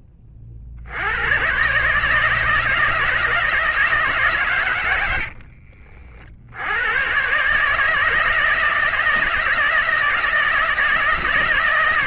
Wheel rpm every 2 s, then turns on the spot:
70, 160, 90, 100, 160, 160.
4-6